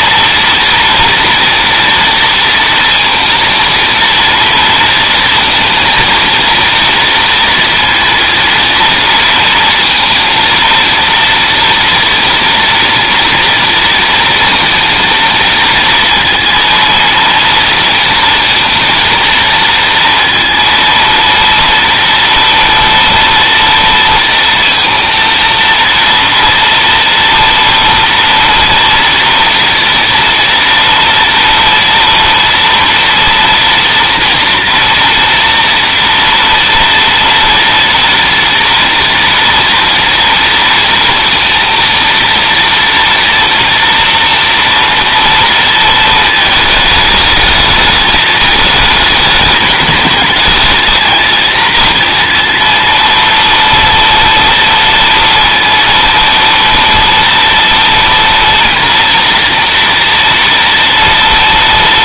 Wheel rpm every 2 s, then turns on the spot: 230, 230, 230, 230, 230, 230, 230, 230, 230, 230, 230, 240, 230, 240, 230, 230, 230, 230, 230, 230, 230, 230, 230, 220, 220, 220, 230, 230, 230, 230, 230.
none